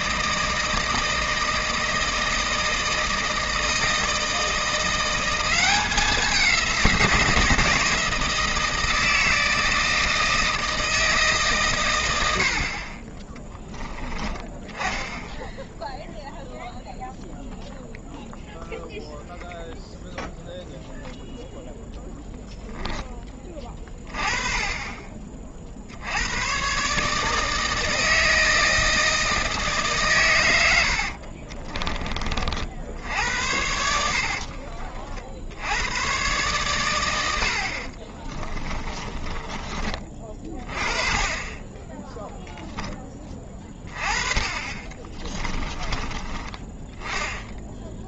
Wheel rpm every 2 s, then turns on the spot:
160, 160, 170, 180, 160, 160, 50, 10, 0, 0, 0, 0, 20, 130, 160, 80, 60, 50, 120, 20, 30, 10, 30, 20.
30-32 38-40 44-46